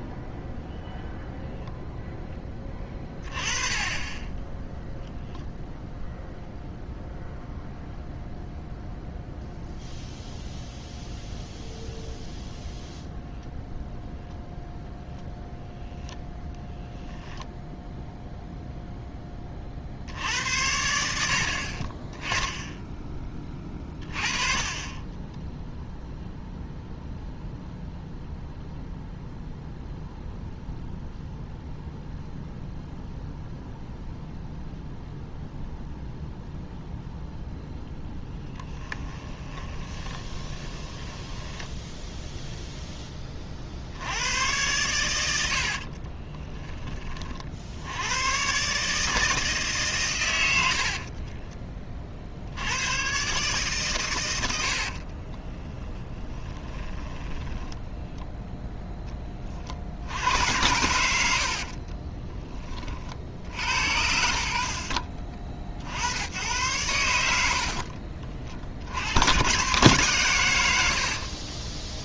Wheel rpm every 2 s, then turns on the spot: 0, 20, 0, 0, 0, 0, 0, 0, 10, 0, 70, 10, 20, 0, 0, 0, 0, 0, 0, 10, 10, 0, 110, 20, 140, 70, 100, 70, 10, 0, 90, 30, 60, 110, 70, 90.
38-42 54-58